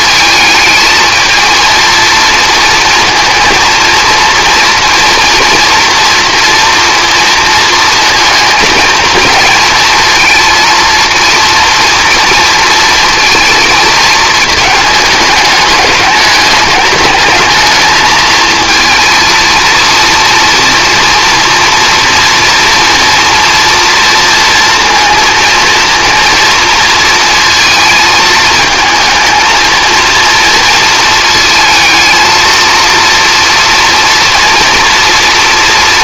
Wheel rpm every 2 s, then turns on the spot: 220, 230, 230, 230, 230, 230, 230, 210, 210, 220, 240, 230, 230, 230, 220, 220, 230, 230.
none